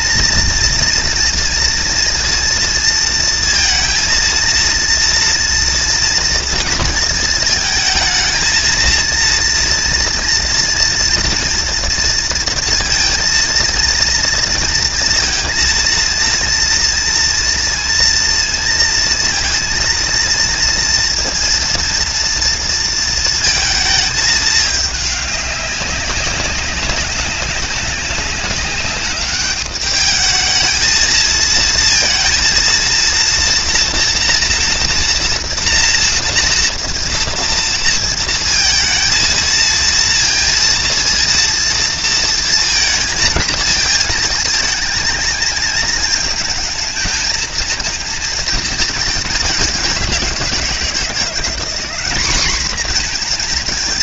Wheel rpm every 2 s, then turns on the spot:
230, 230, 230, 230, 220, 230, 230, 230, 230, 230, 230, 230, 210, 200, 200, 220, 230, 240, 240, 230, 230, 230, 220, 220, 220, 170, 220.
none